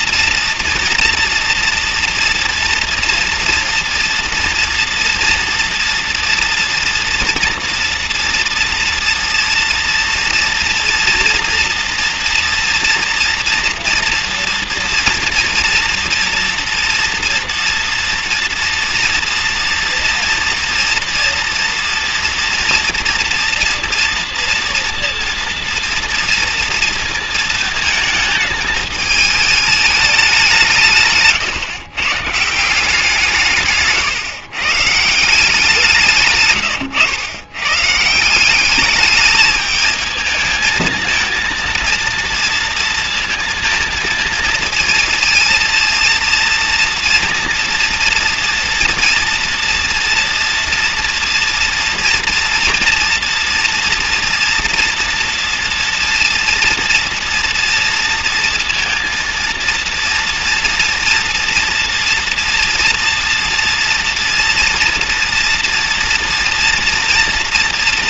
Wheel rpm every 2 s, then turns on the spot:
230, 240, 230, 230, 240, 240, 230, 230, 230, 230, 230, 230, 230, 230, 220, 180, 160, 140, 130, 190, 220, 230, 230, 230, 240, 230, 230, 230, 230, 230, 240, 230, 230, 230.
none